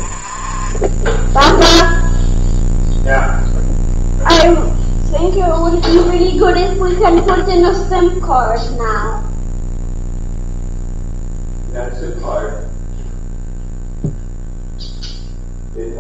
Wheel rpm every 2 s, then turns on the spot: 10, 0, 0, 0, 0, 0, 0, 0.
none